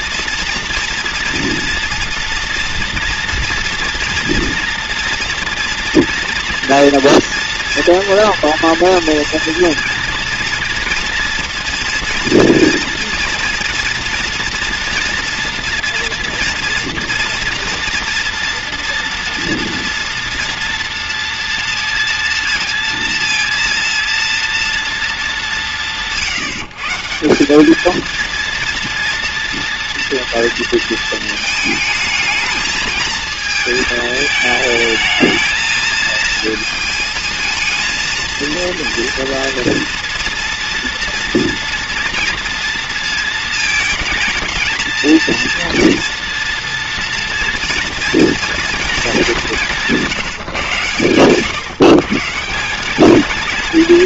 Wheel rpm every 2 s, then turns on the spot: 230, 230, 240, 230, 230, 230, 230, 240, 240, 230, 230, 230, 230, 150, 230, 230, 220, 220, 220, 230, 230, 230, 220, 230, 230, 140, 160.
none